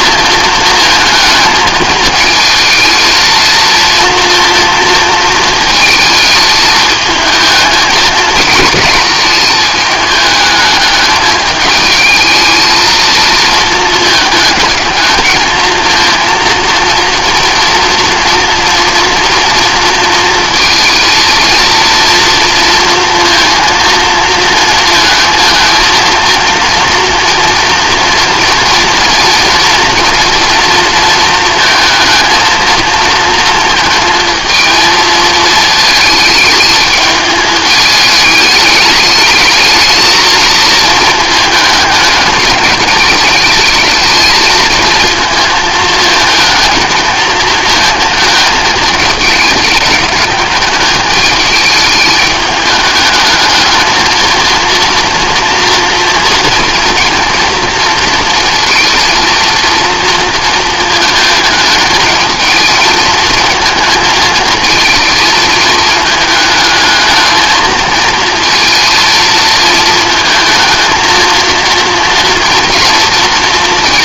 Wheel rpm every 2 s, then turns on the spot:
220, 220, 230, 220, 220, 210, 220, 220, 230, 240, 230, 230, 230, 230, 230, 230, 230, 220, 210, 210, 220, 210, 220, 220, 220, 210, 210, 230, 230, 230, 230, 220, 220, 220, 230, 230, 230.
none